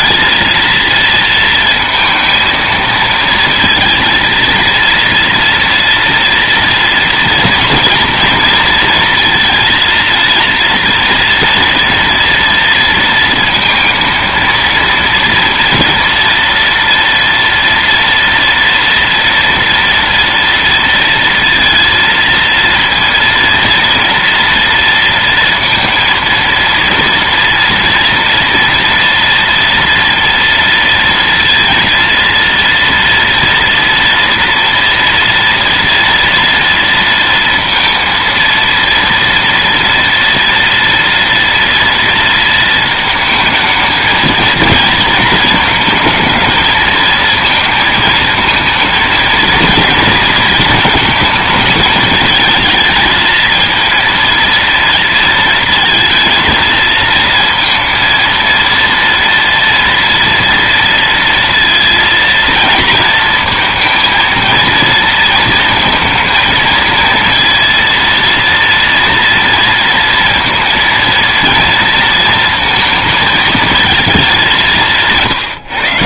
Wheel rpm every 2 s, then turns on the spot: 230, 230, 230, 230, 230, 230, 230, 230, 230, 230, 230, 230, 230, 230, 230, 230, 230, 230, 230, 230, 230, 220, 220, 220, 220, 220, 220, 230, 230, 230, 230, 230, 230, 220, 230, 230, 230, 190.
none